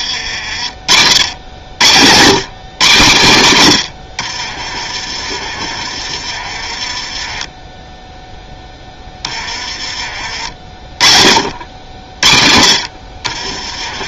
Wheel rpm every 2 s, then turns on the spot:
40, 130, 40, 30, 10, 40, 60.
4-6